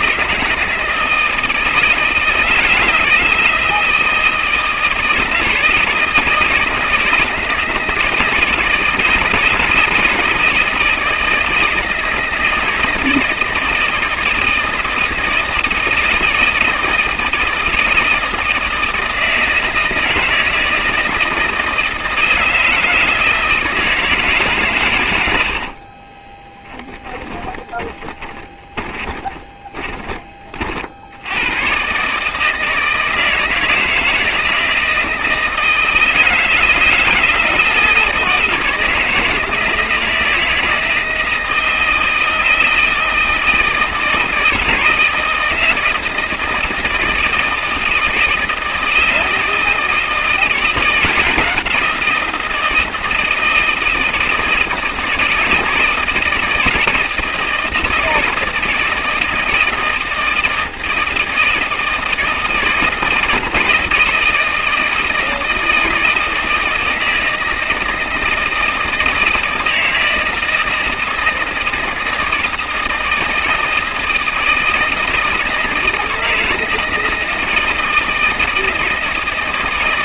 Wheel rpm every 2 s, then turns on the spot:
160, 160, 160, 160, 160, 160, 160, 160, 160, 160, 160, 160, 120, 10, 20, 60, 160, 160, 160, 160, 160, 160, 160, 160, 160, 170, 160, 160, 160, 160, 170, 160, 160, 160, 160, 160, 160, 160, 160, 160.
26-30